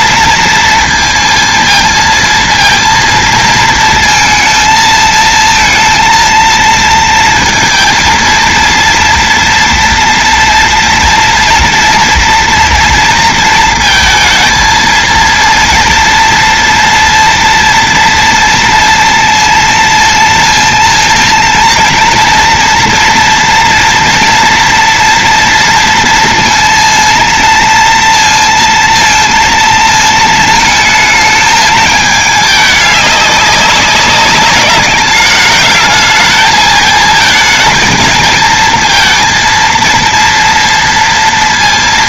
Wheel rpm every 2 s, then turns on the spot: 230, 220, 220, 230, 230, 230, 230, 230, 230, 230, 230, 230, 230, 230, 230, 220, 210, 200, 220, 220, 230.
none